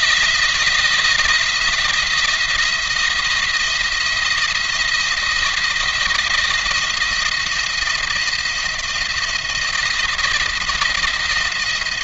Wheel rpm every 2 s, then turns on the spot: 170, 170, 170, 170, 170, 170.
none